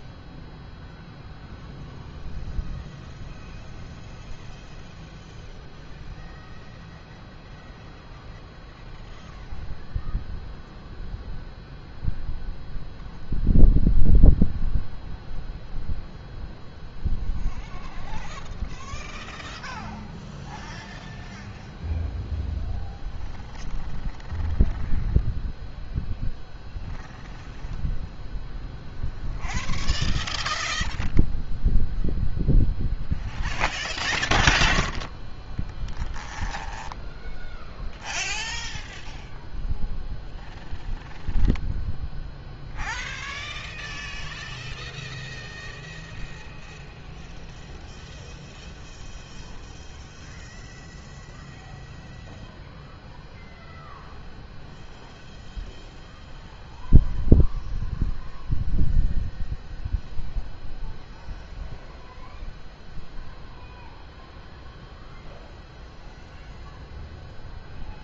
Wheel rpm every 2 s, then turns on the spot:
0, 0, 0, 0, 0, 0, 0, 0, 0, 0, 0, 0, 0, 0, 0, 0, 0, 0, 0, 0, 0, 0, 0, 0, 0, 0, 0, 0, 0, 0, 0, 0, 0, 0.
none